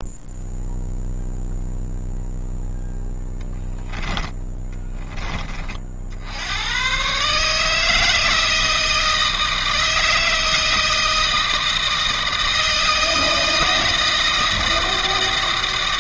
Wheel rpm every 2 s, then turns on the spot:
0, 0, 10, 70, 160, 160, 160, 160.
4-6